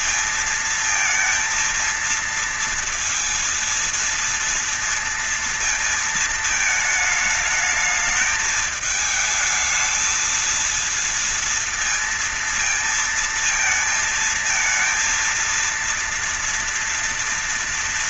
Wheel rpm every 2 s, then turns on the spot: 230, 230, 230, 220, 220, 220, 230, 220, 230.
none